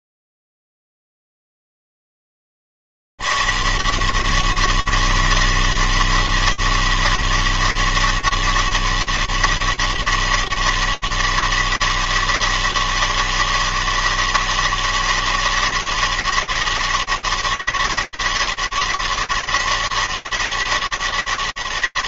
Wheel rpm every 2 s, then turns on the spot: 80, 190, 200, 200, 200, 200, 200, 200, 200, 200, 200.
none